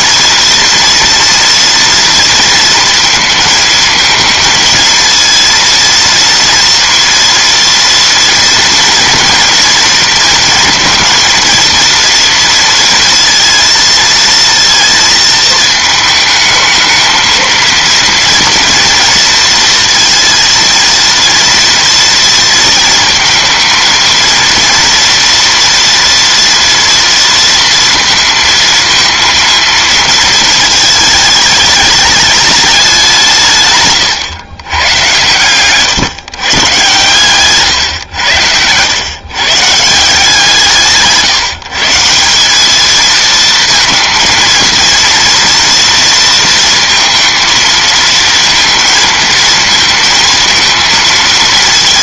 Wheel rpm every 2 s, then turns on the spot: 230, 230, 230, 230, 240, 230, 230, 230, 220, 230, 230, 230, 230, 230, 220, 210, 200, 120, 130, 100, 150, 210, 230, 230, 230, 220.
none